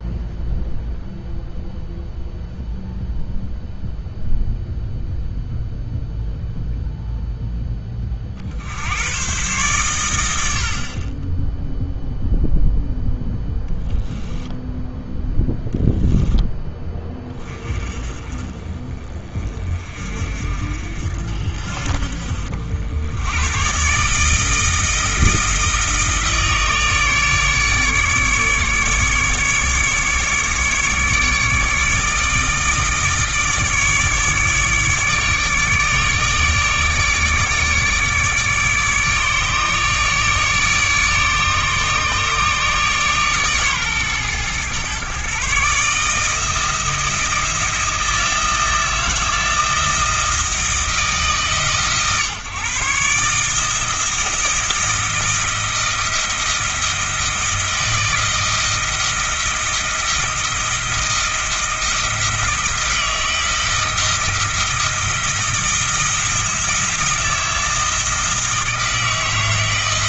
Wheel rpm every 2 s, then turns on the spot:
0, 0, 0, 0, 70, 50, 0, 0, 10, 30, 50, 70, 160, 150, 150, 150, 160, 150, 150, 150, 150, 140, 120, 160, 160, 160, 140, 160, 170, 160, 160, 170, 170, 160, 160.
none